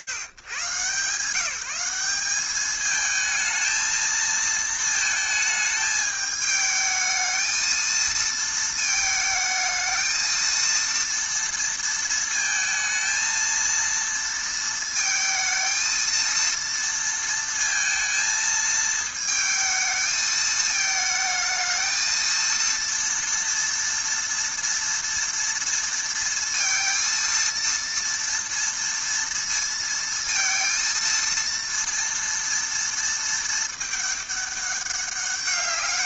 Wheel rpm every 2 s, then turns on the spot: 190, 220, 220, 220, 220, 230, 230, 220, 230, 220, 230, 230, 230, 230, 230, 230, 210, 200.
none